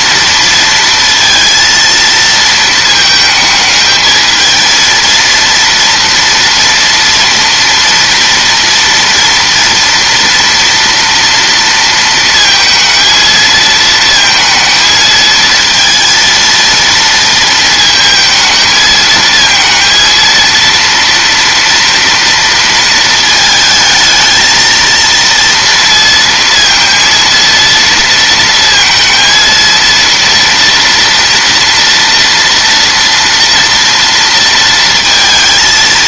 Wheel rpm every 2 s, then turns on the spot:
230, 220, 220, 240, 240, 230, 230, 230, 230, 220, 230, 230, 220, 230, 230, 230, 230, 230.
none